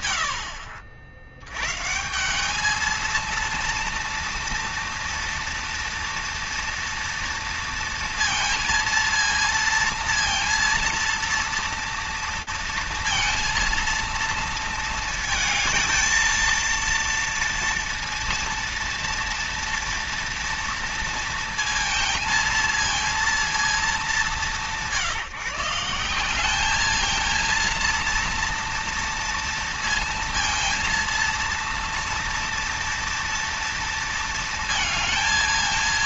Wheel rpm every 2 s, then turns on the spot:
70, 220, 230, 230, 230, 230, 230, 220, 230, 230, 230, 230, 180, 210, 230, 230, 230, 220.
none